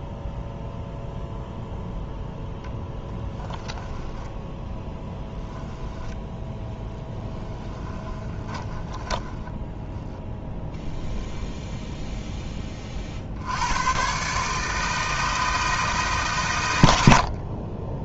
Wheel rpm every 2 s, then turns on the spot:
0, 10, 10, 10, 20, 10, 30, 160, 100.
6-10